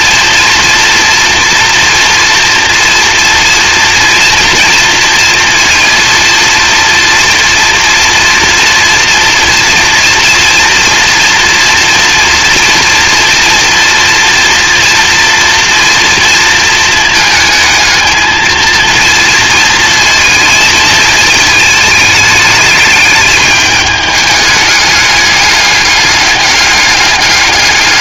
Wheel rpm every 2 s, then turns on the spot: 230, 230, 240, 230, 230, 230, 230, 230, 230, 230, 220, 210, 210, 200.
none